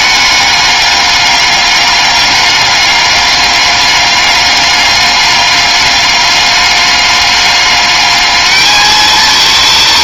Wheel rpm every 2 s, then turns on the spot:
210, 200, 200, 200, 210.
none